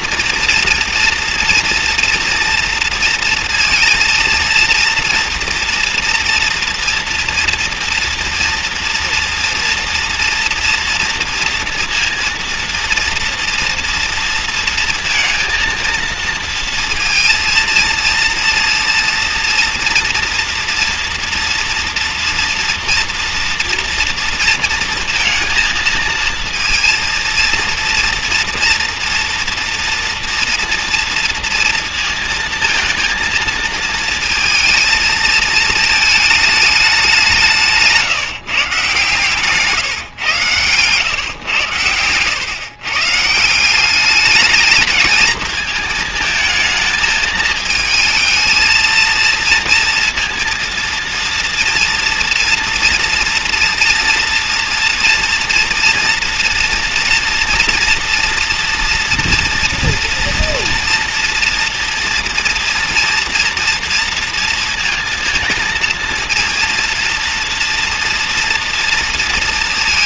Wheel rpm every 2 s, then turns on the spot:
240, 230, 240, 230, 230, 230, 230, 230, 230, 230, 230, 230, 230, 230, 230, 230, 230, 230, 190, 150, 120, 140, 210, 220, 230, 230, 230, 230, 240, 240, 230, 240, 230, 230, 230.
40-42